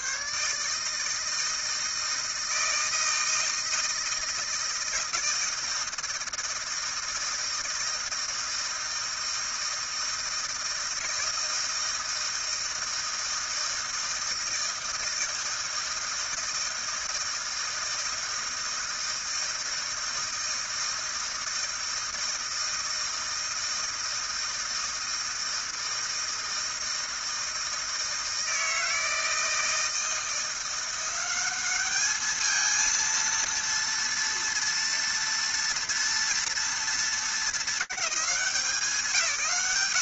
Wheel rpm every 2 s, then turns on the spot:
130, 160, 160, 160, 160, 160, 160, 160, 160, 160, 160, 160, 160, 160, 160, 170, 210, 230, 230, 190.
none